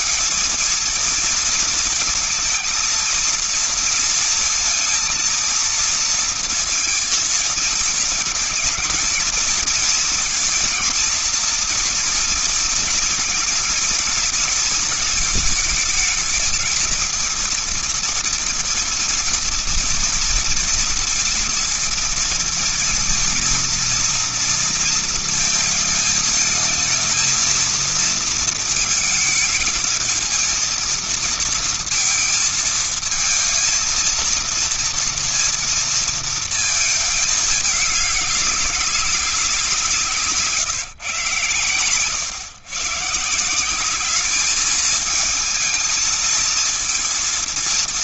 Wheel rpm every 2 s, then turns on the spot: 230, 230, 230, 230, 220, 230, 230, 230, 220, 230, 230, 230, 230, 220, 230, 220, 230, 230, 220, 200, 150, 140, 210, 230.
none